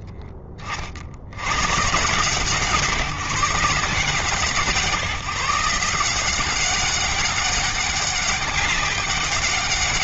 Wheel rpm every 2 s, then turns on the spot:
70, 150, 150, 200, 200.
none